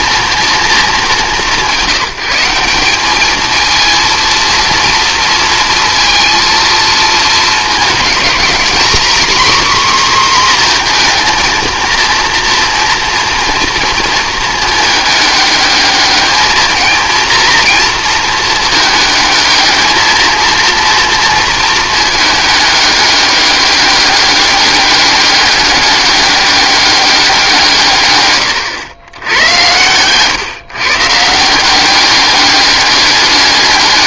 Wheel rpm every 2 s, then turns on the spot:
220, 190, 230, 230, 250, 240, 240, 220, 220, 220, 230, 210, 200, 200, 100, 140, 200.
none